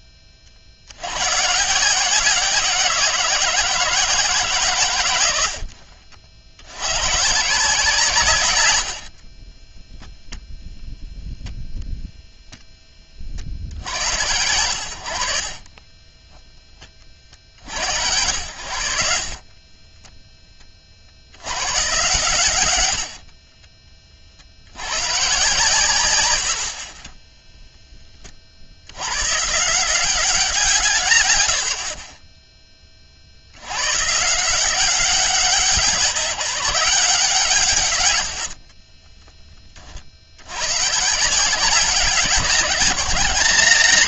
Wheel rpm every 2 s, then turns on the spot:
90, 170, 110, 120, 70, 0, 20, 80, 40, 60, 50, 70, 110, 30, 90, 140, 40, 180, 180, 20, 140, 160.
8-10 18-20 22-24 38-40